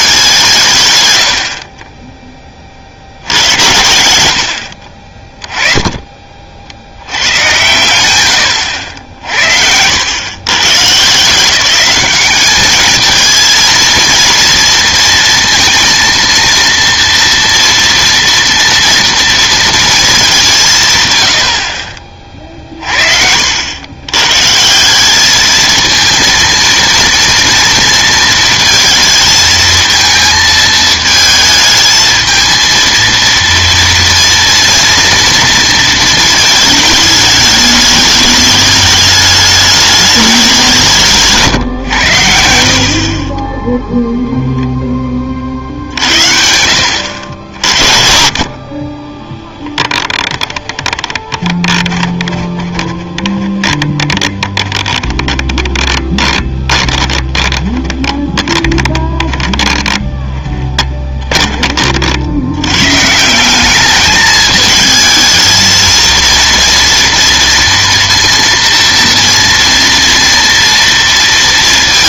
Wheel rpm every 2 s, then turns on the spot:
120, 60, 40, 70, 80, 150, 220, 230, 230, 230, 160, 40, 180, 230, 230, 220, 230, 230, 220, 210, 180, 60, 10, 70, 40, 10, 20, 20, 20, 20, 20, 90, 220, 230, 230, 230.
50-62